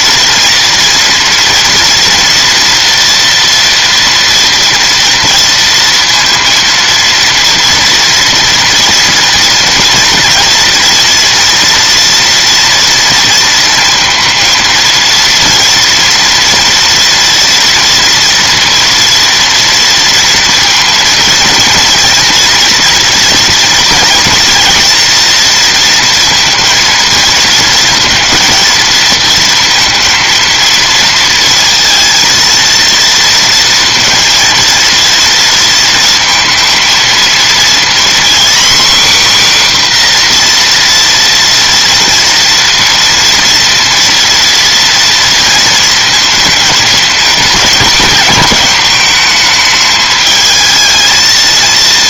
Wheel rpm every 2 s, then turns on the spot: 230, 240, 230, 230, 230, 230, 230, 230, 230, 230, 230, 240, 230, 230, 230, 230, 230, 230, 230, 260, 250, 230, 230, 220, 220, 220.
none